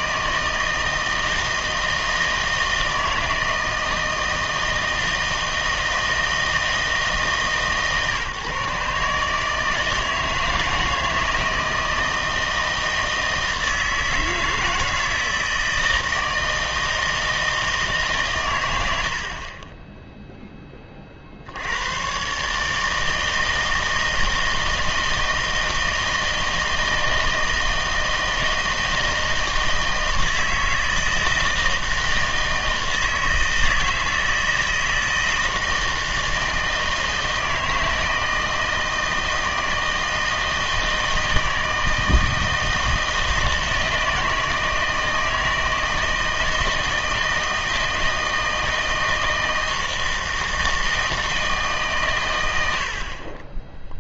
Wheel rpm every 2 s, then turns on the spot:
160, 160, 160, 160, 150, 160, 160, 160, 160, 100, 10, 150, 160, 160, 160, 160, 160, 160, 160, 160, 160, 160, 160, 160, 160, 160, 90.
none